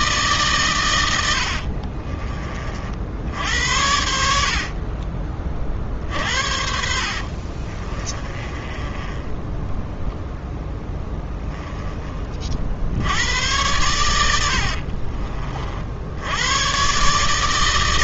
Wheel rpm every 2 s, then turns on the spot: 110, 50, 40, 60, 20, 10, 70, 50, 130.
4-12 14-16